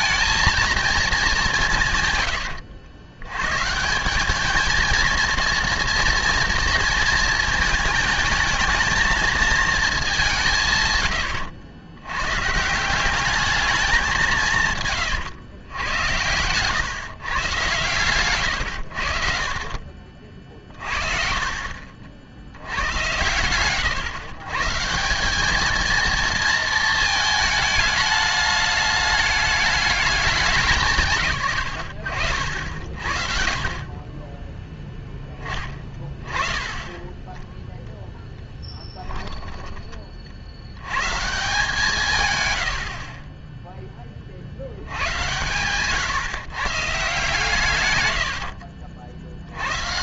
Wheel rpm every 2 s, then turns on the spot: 230, 80, 230, 230, 220, 130, 160, 140, 130, 110, 50, 90, 150, 230, 210, 170, 60, 0, 20, 10, 90, 80, 100, 150, 80.
2-4 18-20 36-40 42-44 48-50